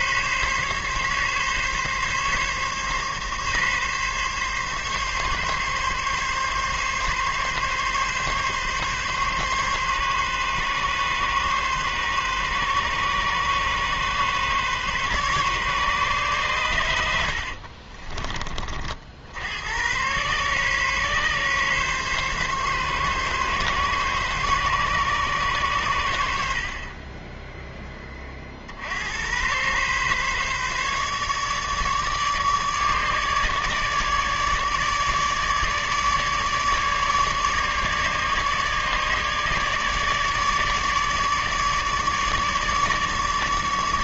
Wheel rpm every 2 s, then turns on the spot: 140, 140, 140, 140, 140, 140, 140, 140, 100, 40, 130, 140, 140, 40, 60, 140, 150, 150, 150, 150, 150, 150.
none